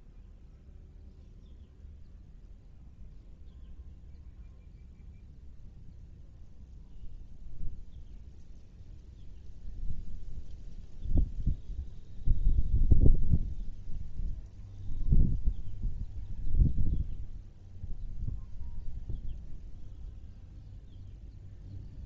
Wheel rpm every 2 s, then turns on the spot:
0, 0, 0, 0, 0, 0, 0, 0, 0, 0, 0.
none